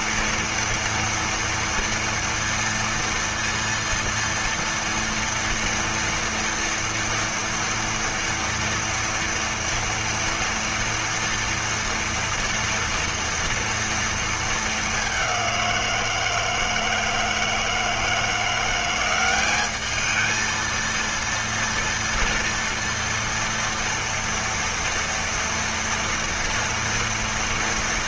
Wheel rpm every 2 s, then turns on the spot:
230, 230, 230, 230, 230, 230, 230, 200, 160, 190, 230, 230, 230, 230.
none